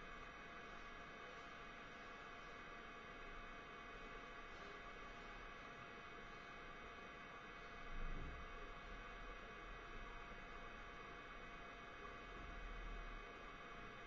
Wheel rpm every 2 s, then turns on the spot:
0, 0, 0, 0, 0, 0, 0.
none